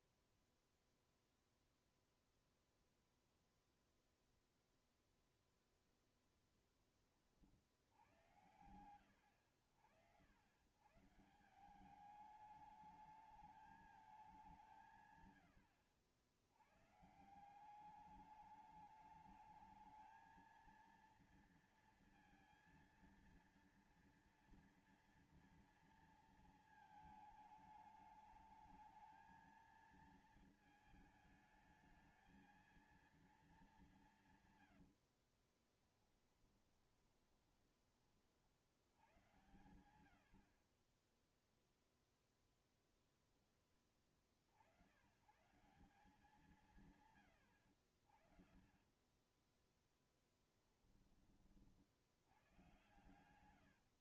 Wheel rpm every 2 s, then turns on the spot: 0, 0, 0, 10, 100, 100, 210, 170, 100, 210, 220, 230, 230, 230, 220, 220, 220, 130, 20, 70, 50, 0, 70, 150, 30, 10, 100.
34-38 48-50 52-54